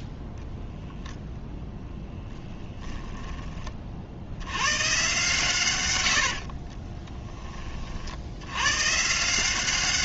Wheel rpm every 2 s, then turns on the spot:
10, 10, 100, 50, 100.
0-4 6-8